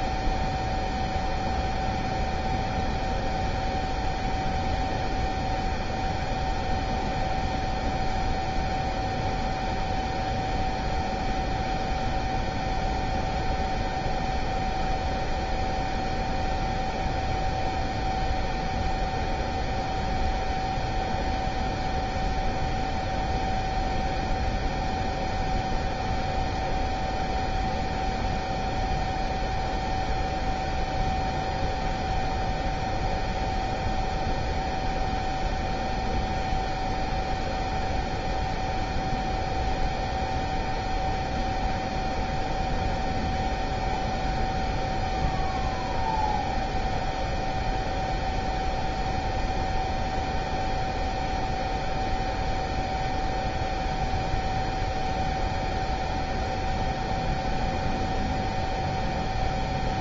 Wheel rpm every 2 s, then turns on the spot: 0, 0, 0, 0, 0, 0, 0, 0, 0, 0, 0, 0, 0, 0, 0, 0, 0, 0, 0, 0, 0, 0, 0, 0, 0, 0, 0, 0, 0, 0.
none